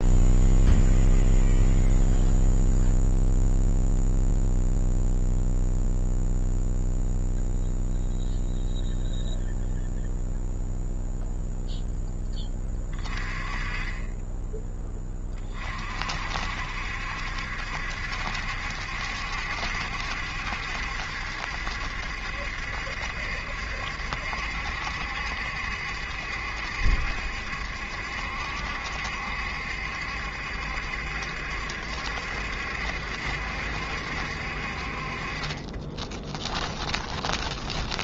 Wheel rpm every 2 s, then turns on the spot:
0, 0, 0, 0, 0, 0, 10, 20, 60, 70, 70, 70, 70, 70, 70, 70, 70, 60, 20.
36-38